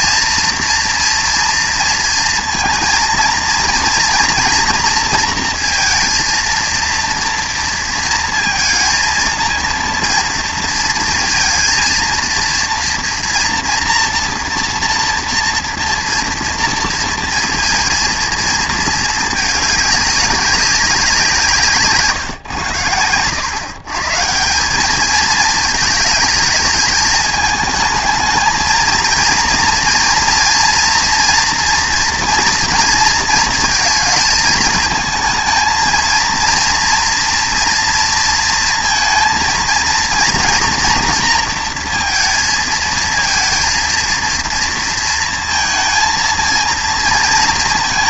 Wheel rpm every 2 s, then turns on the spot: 230, 230, 240, 230, 230, 230, 230, 240, 230, 230, 190, 100, 200, 210, 220, 230, 230, 220, 230, 230, 240, 230, 230, 230.
none